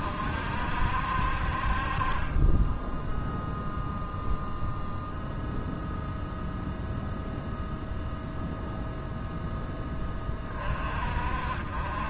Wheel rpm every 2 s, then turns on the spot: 50, 20, 0, 0, 0, 40.
none